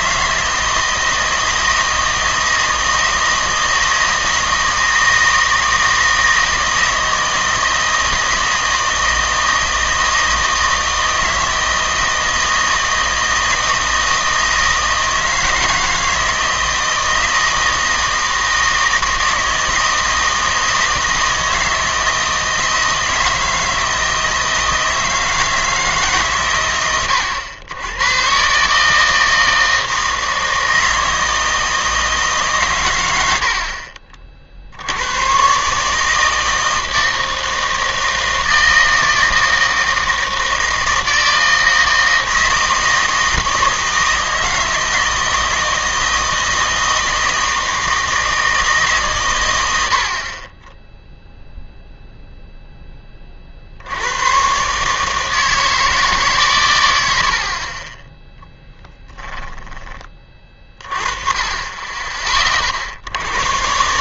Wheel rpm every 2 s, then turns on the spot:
160, 160, 160, 160, 160, 160, 160, 160, 160, 160, 160, 160, 160, 110, 140, 160, 130, 60, 160, 160, 160, 160, 160, 160, 160, 20, 10, 140, 110, 10, 30, 50.
58-60